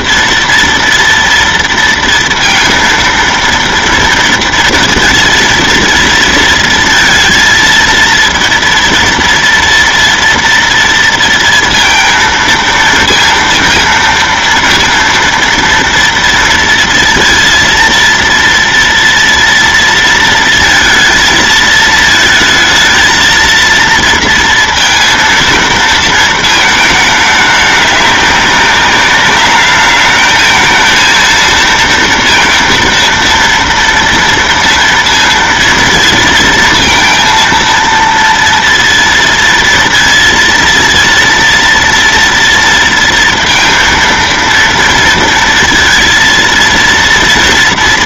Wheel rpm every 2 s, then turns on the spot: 230, 230, 230, 230, 230, 230, 230, 230, 230, 230, 230, 220, 230, 220, 200, 220, 230, 230, 230, 230, 230, 230, 230, 230.
none